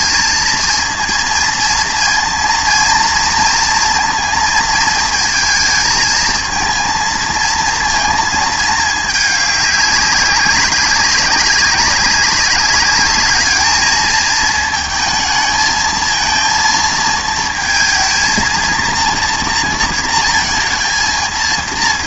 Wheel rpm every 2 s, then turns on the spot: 230, 230, 220, 220, 210, 200, 200, 230, 230, 230, 220.
none